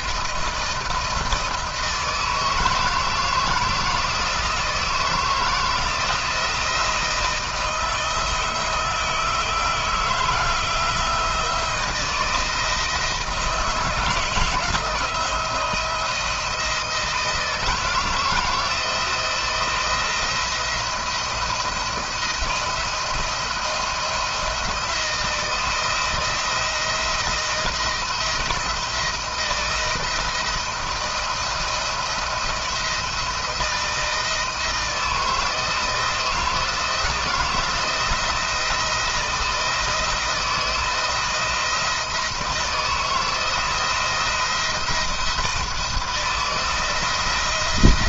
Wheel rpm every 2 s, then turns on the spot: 160, 160, 160, 170, 160, 160, 160, 170, 160, 160, 170, 170, 170, 170, 160, 160, 160, 160, 170, 170, 170, 160, 170, 170.
none